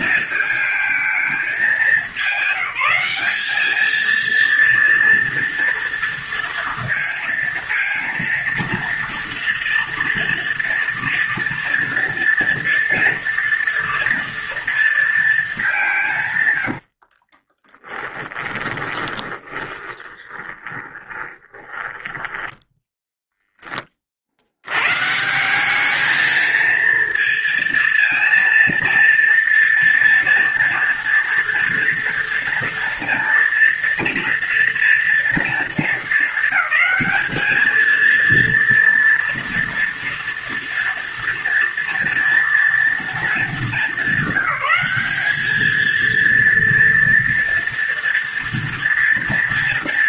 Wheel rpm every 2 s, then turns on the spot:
220, 190, 230, 230, 230, 230, 230, 230, 70, 20, 20, 10, 120, 230, 230, 230, 230, 230, 220, 230, 230, 230, 200, 230, 230.
16-22